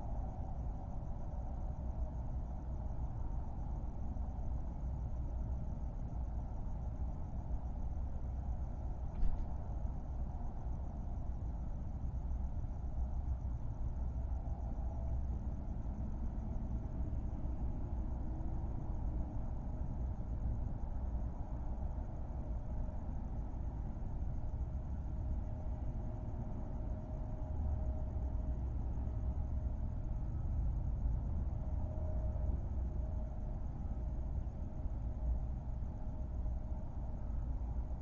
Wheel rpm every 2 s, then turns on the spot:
0, 0, 0, 0, 0, 0, 0, 0, 0, 0, 0, 0, 0, 0, 0, 0, 0, 0, 0.
none